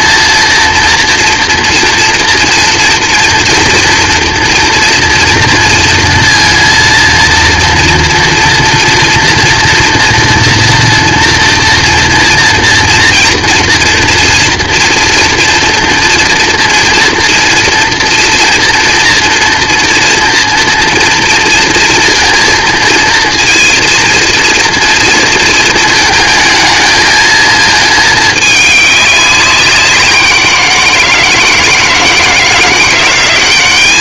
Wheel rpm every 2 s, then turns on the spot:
230, 230, 230, 230, 230, 230, 230, 230, 230, 230, 230, 230, 230, 220, 210, 170, 160.
none